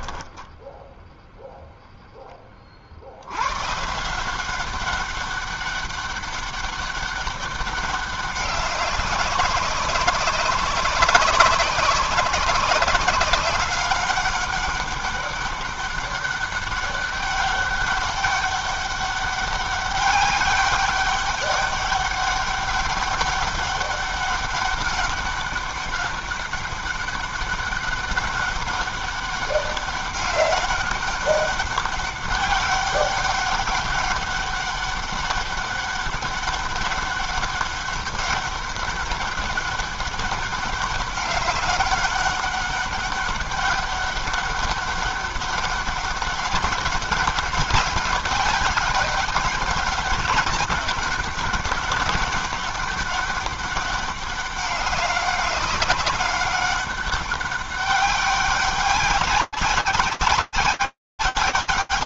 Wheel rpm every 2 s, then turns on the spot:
10, 10, 170, 200, 200, 190, 190, 200, 200, 200, 200, 200, 200, 200, 200, 200, 200, 200, 200, 200, 200, 200, 200, 200, 190, 200, 200, 200, 200, 190, 180.
0-2